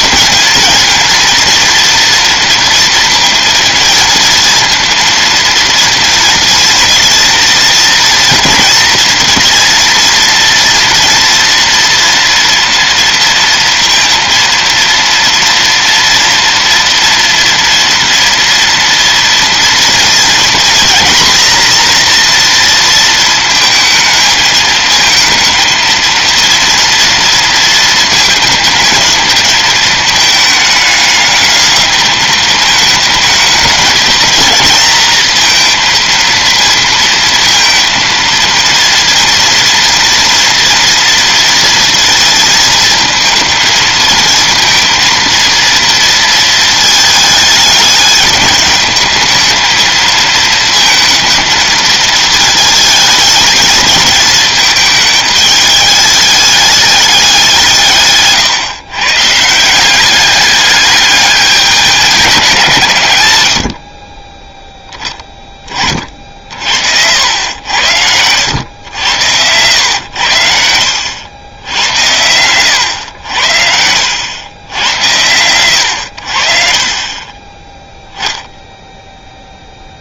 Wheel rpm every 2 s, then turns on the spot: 220, 230, 230, 230, 240, 230, 230, 230, 230, 230, 230, 230, 220, 230, 220, 210, 220, 220, 230, 230, 230, 230, 230, 220, 210, 230, 220, 220, 210, 140, 210, 170, 10, 60, 90, 80, 100, 90, 40, 10.
none